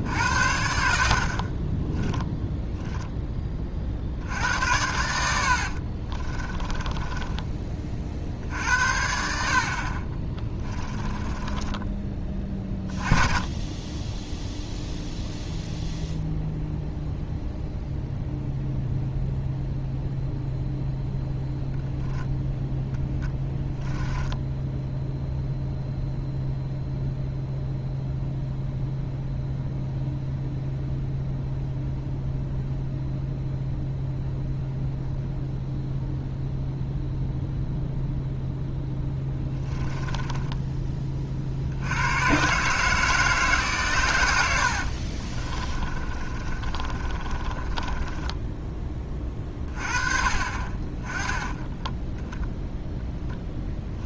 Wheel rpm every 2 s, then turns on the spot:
80, 0, 80, 20, 60, 20, 20, 0, 0, 0, 0, 10, 0, 0, 0, 0, 0, 0, 0, 10, 20, 130, 80, 30, 10, 30, 0.
4-8 10-12 44-48